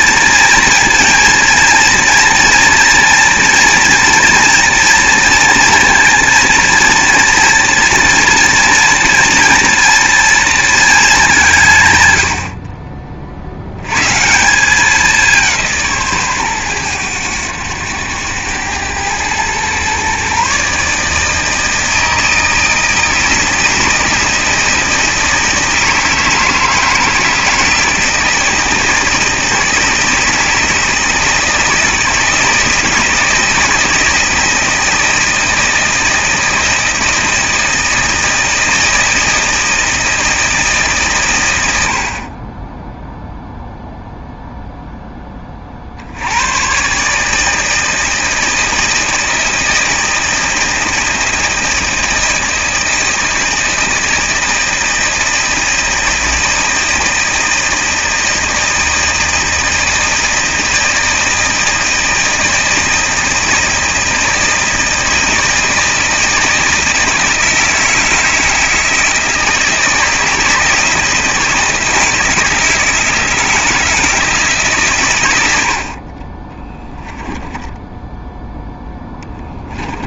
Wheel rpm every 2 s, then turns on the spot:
230, 230, 230, 230, 230, 220, 40, 190, 110, 100, 150, 160, 160, 160, 160, 160, 160, 160, 160, 160, 150, 20, 0, 130, 160, 160, 160, 160, 160, 160, 160, 160, 160, 160, 160, 160, 160, 150, 10, 10.
76-78